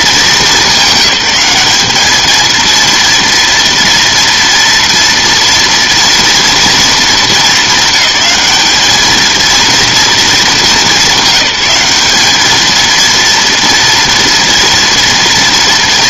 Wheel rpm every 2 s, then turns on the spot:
200, 230, 240, 230, 200, 210, 220, 230.
none